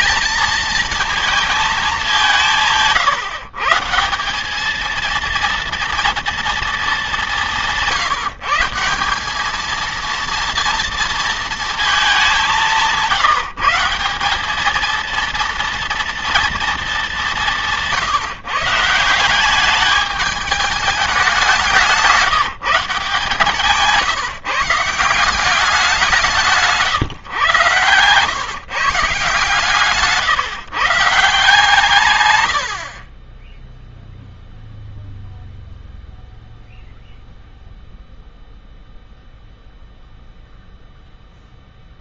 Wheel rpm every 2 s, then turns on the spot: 230, 150, 210, 220, 180, 230, 180, 210, 220, 170, 210, 170, 160, 170, 140, 150, 60, 0, 0, 0, 0.
none